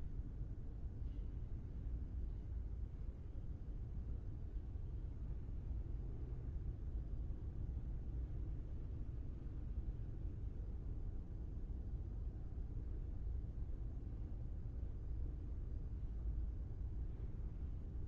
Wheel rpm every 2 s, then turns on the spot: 0, 0, 0, 0, 0, 0, 0, 0, 0.
none